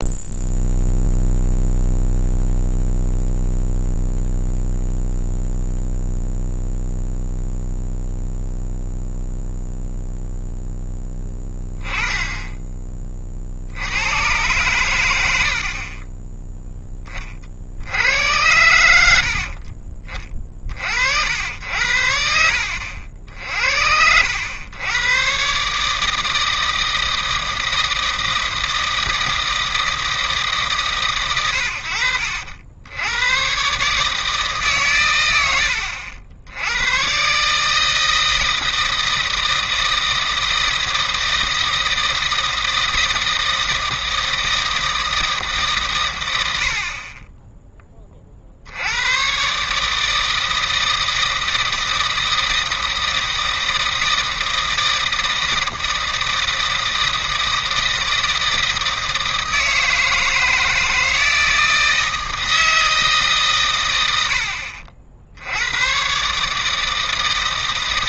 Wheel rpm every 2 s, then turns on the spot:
0, 0, 0, 0, 0, 0, 10, 120, 10, 90, 50, 70, 90, 160, 160, 150, 70, 140, 80, 160, 160, 160, 160, 80, 70, 160, 160, 160, 160, 160, 160, 160, 60, 150.
none